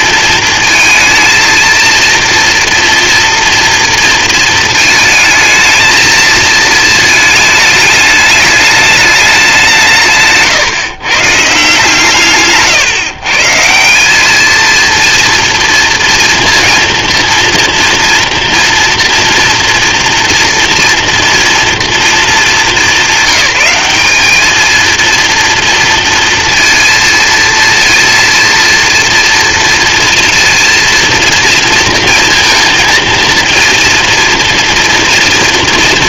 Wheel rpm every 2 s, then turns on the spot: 230, 240, 220, 220, 200, 150, 140, 230, 230, 240, 240, 190, 230, 230, 230, 230, 230, 230.
none